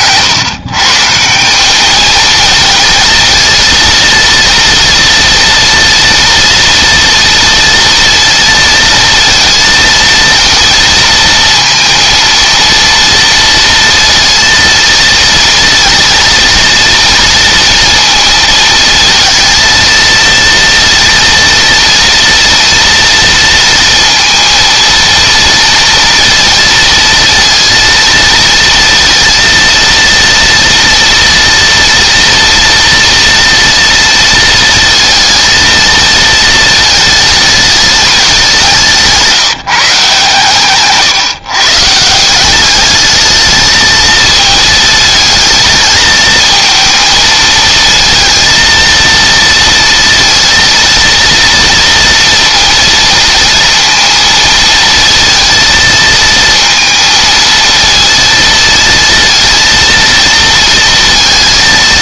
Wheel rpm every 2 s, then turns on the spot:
140, 220, 230, 230, 230, 230, 230, 230, 230, 230, 230, 230, 230, 230, 230, 230, 230, 220, 220, 170, 140, 210, 220, 220, 230, 230, 230, 230, 230, 230, 230.
40-42